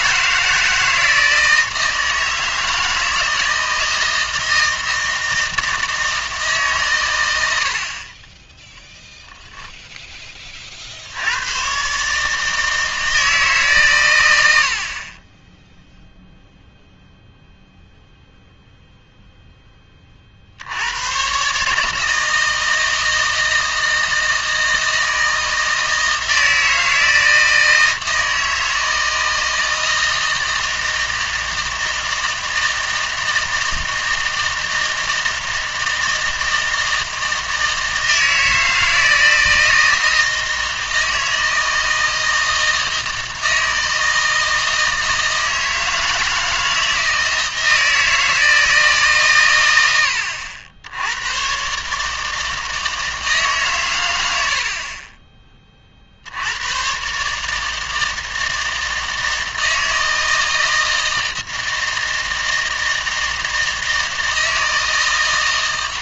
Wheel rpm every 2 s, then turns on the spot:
160, 160, 160, 130, 0, 60, 160, 60, 0, 0, 90, 160, 160, 160, 160, 160, 160, 160, 160, 160, 160, 160, 160, 160, 150, 70, 160, 40, 110, 160, 160, 160, 160.
none